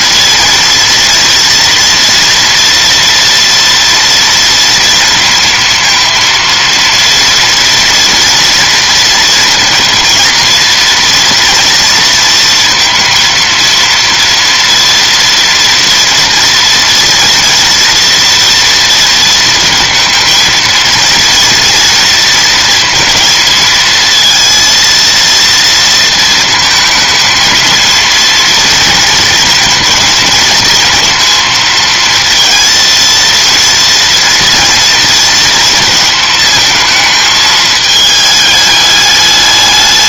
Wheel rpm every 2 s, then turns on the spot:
230, 230, 230, 230, 230, 230, 230, 230, 230, 230, 230, 230, 230, 230, 230, 230, 230, 230, 220, 210.
none